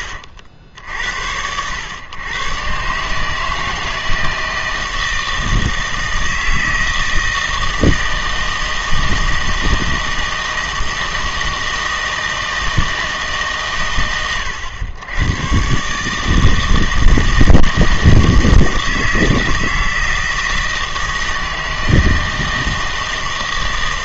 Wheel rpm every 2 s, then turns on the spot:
80, 130, 160, 160, 160, 160, 160, 100, 160, 160, 160, 160.
none